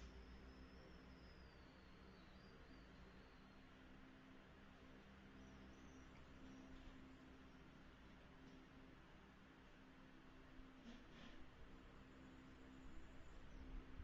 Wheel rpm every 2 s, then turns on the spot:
0, 0, 0, 0, 0, 0, 0.
none